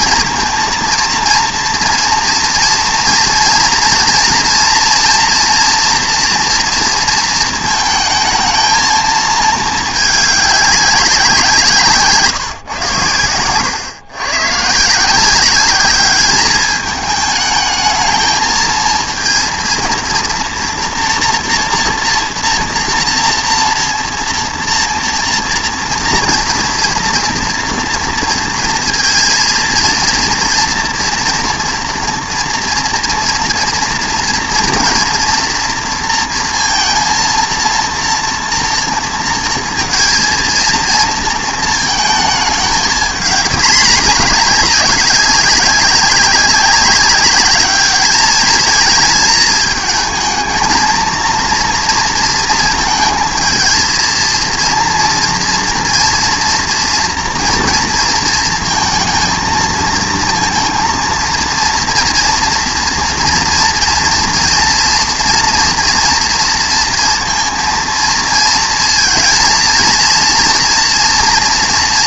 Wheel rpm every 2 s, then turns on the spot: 230, 230, 230, 230, 220, 200, 130, 130, 210, 220, 230, 230, 230, 230, 230, 230, 230, 240, 230, 230, 230, 210, 210, 190, 220, 220, 230, 230, 230, 230, 230, 230, 240, 240, 230, 230.
none